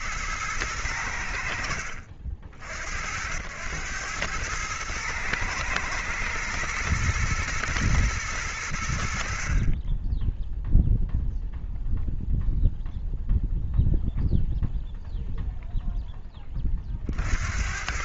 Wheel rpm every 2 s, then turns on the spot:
30, 100, 110, 110, 20, 0, 0, 0, 80.
none